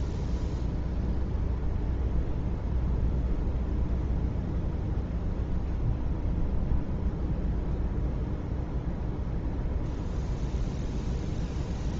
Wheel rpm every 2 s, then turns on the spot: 0, 0, 0, 0, 0, 0.
none